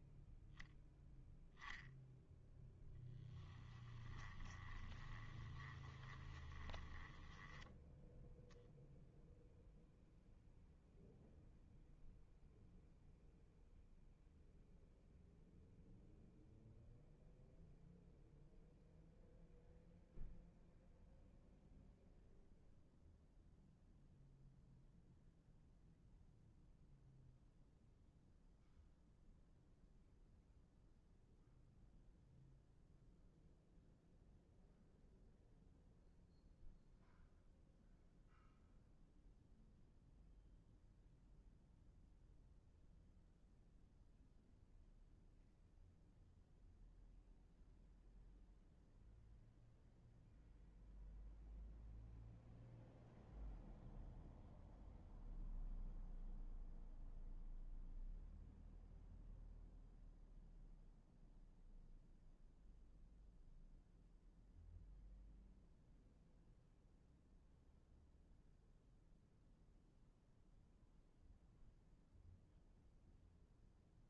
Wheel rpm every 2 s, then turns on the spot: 0, 0, 20, 10, 0, 0, 0, 0, 0, 0, 0, 0, 0, 0, 0, 0, 0, 0, 0, 0, 0, 0, 0, 0, 0, 0, 0, 0, 0, 0, 0, 0, 0, 0, 0, 0, 0.
4-8